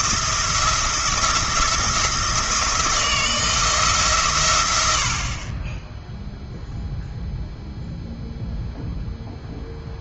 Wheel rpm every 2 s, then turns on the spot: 170, 160, 90, 0, 0.
none